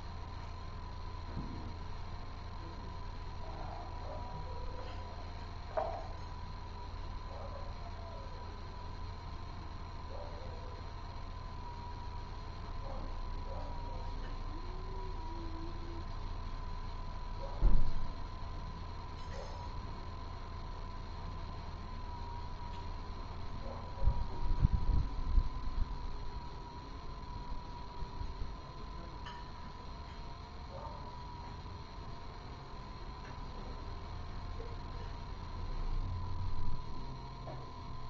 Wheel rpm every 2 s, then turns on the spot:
0, 0, 0, 0, 0, 0, 0, 0, 0, 0, 0, 0, 0, 0, 0, 0, 0, 0, 0.
none